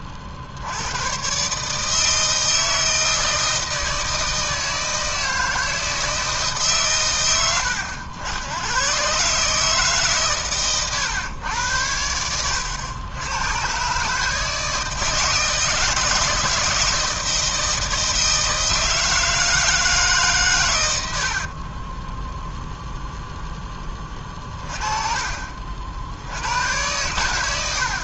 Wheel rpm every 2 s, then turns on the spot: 60, 160, 160, 150, 90, 130, 90, 150, 160, 160, 130, 10, 30, 90.
12-14